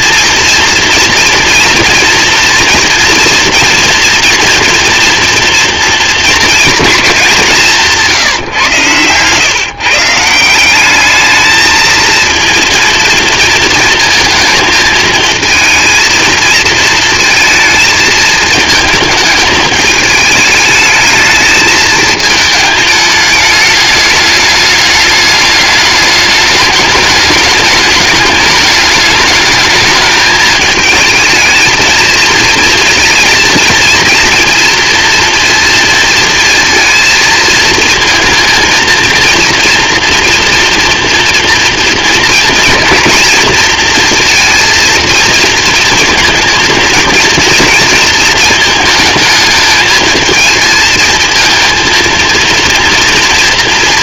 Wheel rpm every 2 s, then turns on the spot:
230, 230, 240, 220, 130, 200, 230, 220, 230, 220, 210, 210, 210, 210, 210, 220, 230, 230, 230, 230, 230, 230, 230, 230, 220, 220, 230.
none